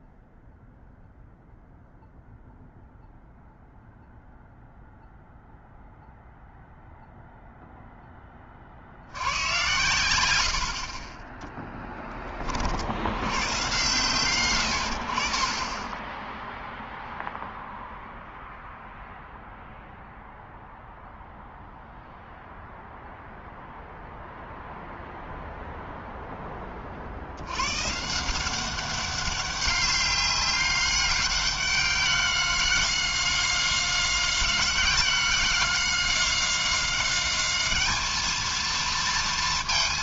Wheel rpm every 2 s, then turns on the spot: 0, 0, 0, 0, 20, 70, 30, 130, 0, 0, 0, 0, 0, 10, 180, 200, 190, 190, 190, 220.
none